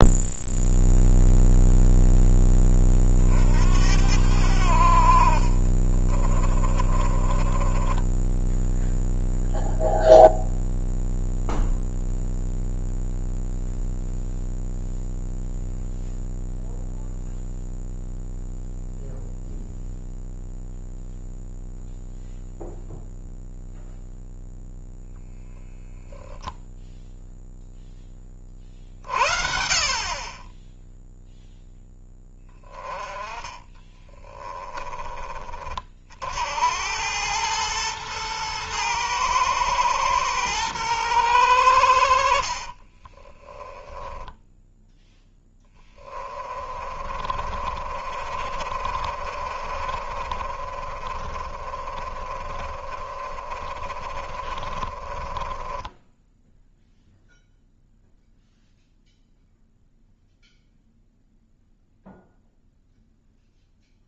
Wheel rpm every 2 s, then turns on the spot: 0, 20, 70, 30, 10, 0, 0, 0, 0, 0, 0, 0, 0, 0, 30, 20, 10, 20, 80, 110, 110, 50, 10, 30, 50, 40, 30, 40, 10, 0, 0, 0.
6-10 42-58